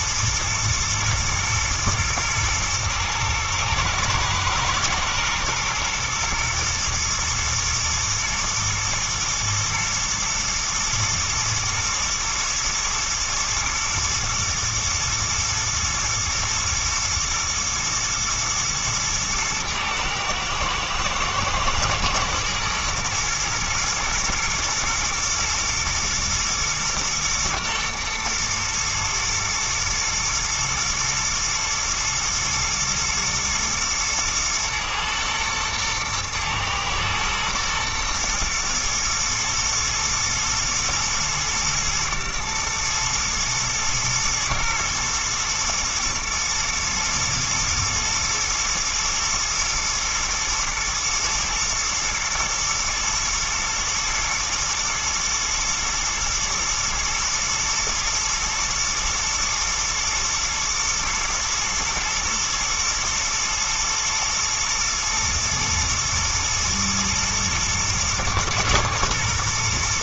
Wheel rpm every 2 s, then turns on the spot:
120, 110, 120, 110, 120, 120, 120, 120, 120, 110, 120, 120, 110, 120, 120, 120, 120, 110, 110, 110, 110, 110, 120, 110, 120, 120, 120, 120, 120, 120, 120, 110, 120, 110, 120.
none